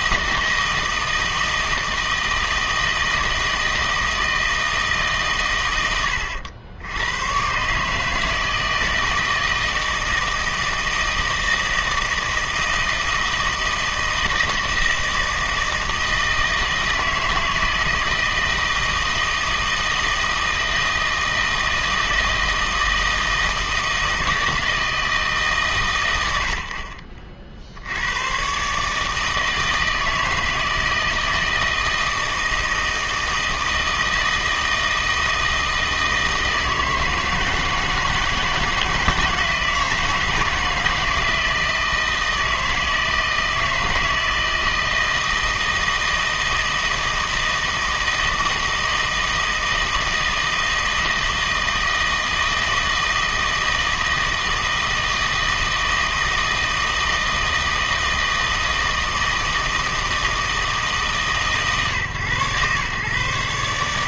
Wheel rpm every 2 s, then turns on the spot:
160, 160, 160, 100, 160, 160, 160, 160, 160, 160, 160, 160, 160, 80, 130, 160, 160, 160, 160, 160, 160, 160, 160, 160, 160, 160, 160, 160, 160, 160, 160, 120.
none